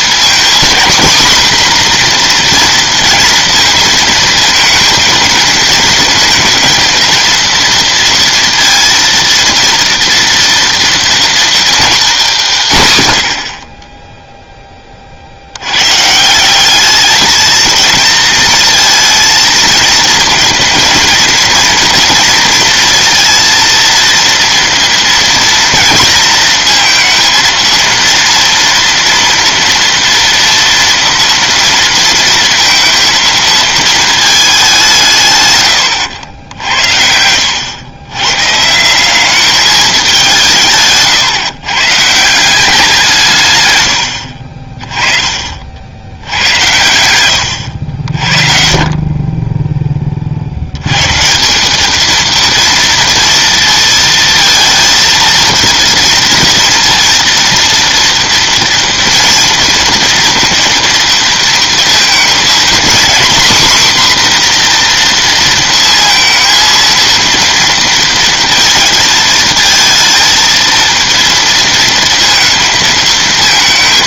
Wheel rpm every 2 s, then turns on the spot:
230, 240, 220, 220, 230, 230, 160, 10, 190, 230, 230, 230, 230, 230, 230, 230, 230, 200, 80, 160, 160, 180, 40, 90, 40, 120, 230, 230, 230, 230, 230, 250, 240, 230, 220, 230, 220.
40-42